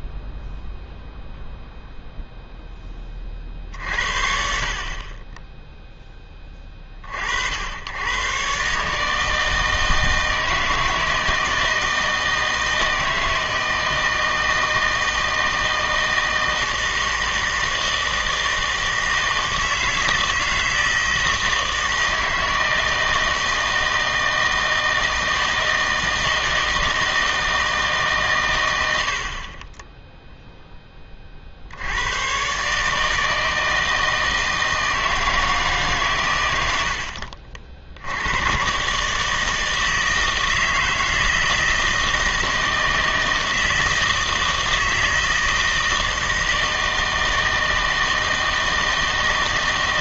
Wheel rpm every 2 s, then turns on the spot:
0, 10, 50, 30, 140, 160, 160, 160, 160, 160, 160, 160, 160, 160, 110, 10, 140, 160, 100, 120, 160, 160, 160, 160, 160.
none